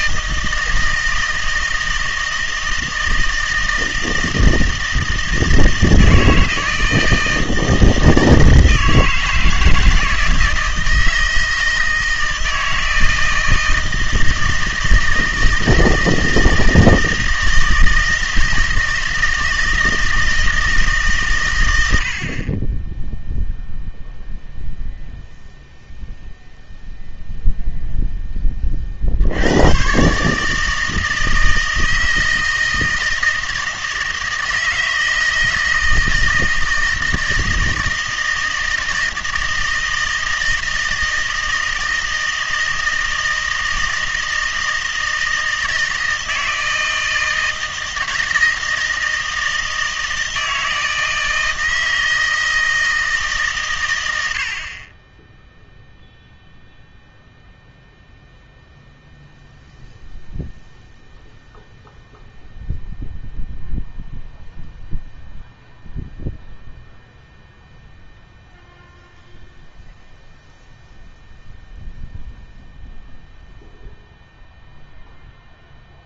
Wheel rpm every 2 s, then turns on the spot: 160, 160, 160, 160, 160, 160, 160, 160, 160, 160, 160, 20, 0, 0, 30, 160, 160, 160, 160, 160, 160, 160, 160, 160, 160, 160, 160, 50, 0, 0, 0, 0, 0, 0, 0, 0, 0, 0.
none